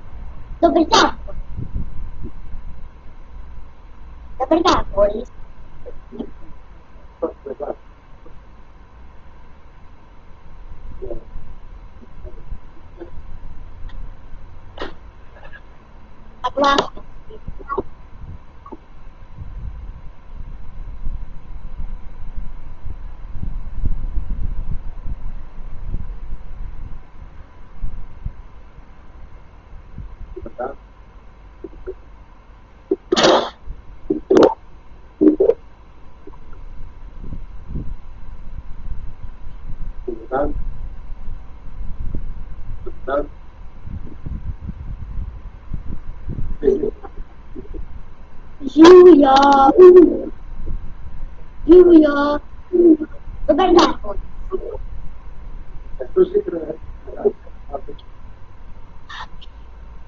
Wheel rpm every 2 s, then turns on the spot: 0, 0, 0, 0, 0, 0, 0, 0, 0, 0, 0, 0, 0, 0, 0, 0, 0, 0, 0, 0, 0, 0, 0, 0, 0, 0, 0, 0, 0, 0.
none